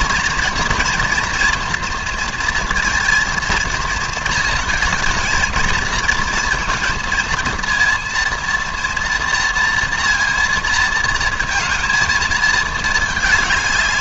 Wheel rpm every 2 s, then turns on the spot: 230, 230, 220, 220, 240, 230, 220.
none